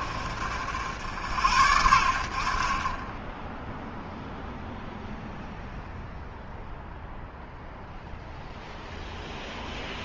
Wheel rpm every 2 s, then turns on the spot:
80, 20, 0, 0, 0.
none